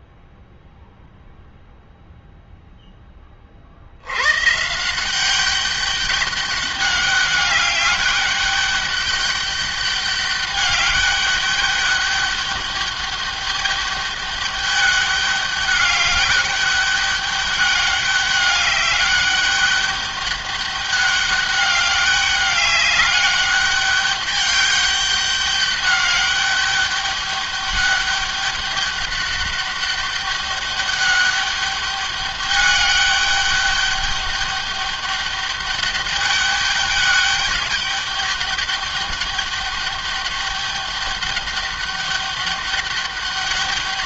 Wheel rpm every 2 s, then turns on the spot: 0, 10, 150, 200, 200, 200, 200, 200, 200, 200, 200, 200, 200, 200, 200, 200, 200, 200, 200, 200, 200, 200.
none